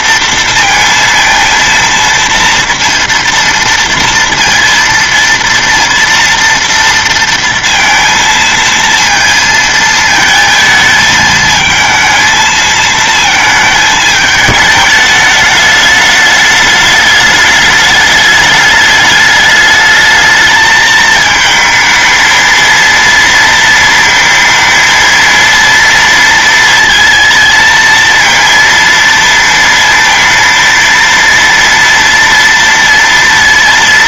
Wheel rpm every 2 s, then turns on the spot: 230, 230, 230, 230, 230, 220, 220, 210, 210, 210, 220, 230, 230, 230, 230, 230, 230.
none